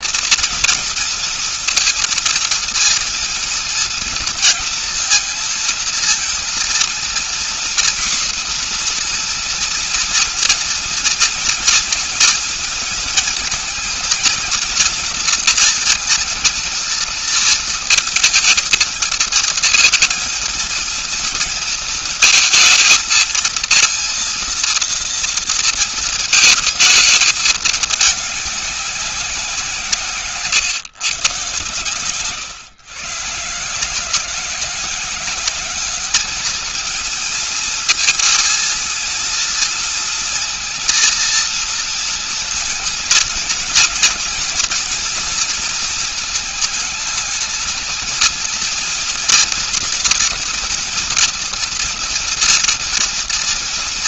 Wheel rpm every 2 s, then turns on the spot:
230, 230, 230, 230, 240, 240, 230, 230, 230, 230, 230, 220, 230, 230, 200, 130, 120, 180, 210, 230, 230, 230, 240, 220, 230, 230, 230.
none